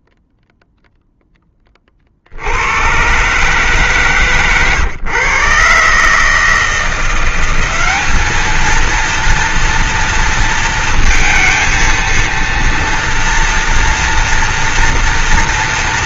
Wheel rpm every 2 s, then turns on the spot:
0, 90, 140, 160, 220, 230, 230, 230.
none